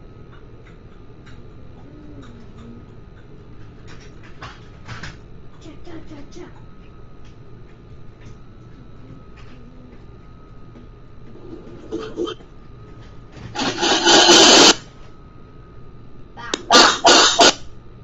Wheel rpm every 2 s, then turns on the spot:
0, 0, 0, 0, 0, 0, 0, 0, 0.
none